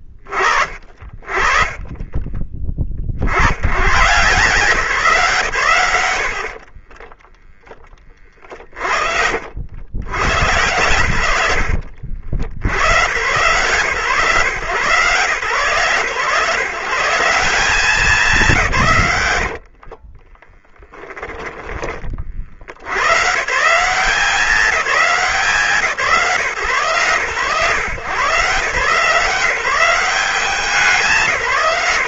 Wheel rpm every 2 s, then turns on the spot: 50, 30, 150, 90, 40, 120, 70, 140, 140, 200, 20, 50, 190, 140, 140, 190.
2-4 8-10 20-22